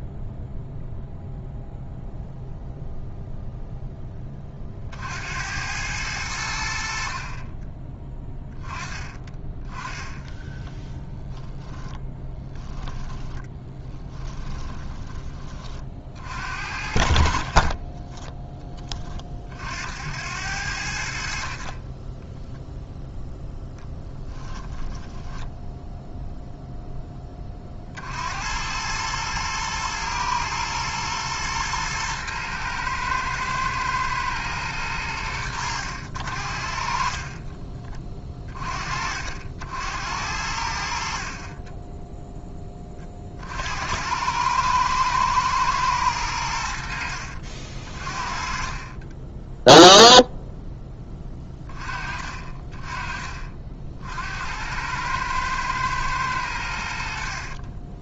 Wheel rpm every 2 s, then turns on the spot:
0, 0, 50, 60, 20, 10, 10, 20, 50, 20, 70, 0, 10, 10, 110, 110, 110, 100, 50, 30, 60, 20, 110, 80, 30, 0, 30, 80, 100.
10-14 24-26 48-50